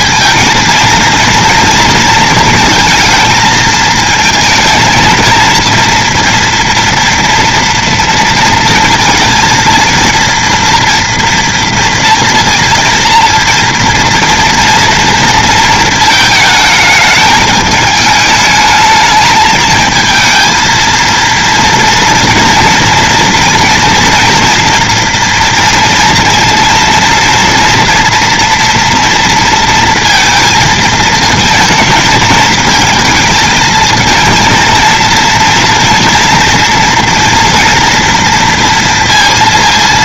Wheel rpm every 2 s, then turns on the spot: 230, 220, 220, 230, 230, 230, 230, 230, 220, 210, 230, 230, 230, 230, 230, 220, 220, 230, 230, 230.
none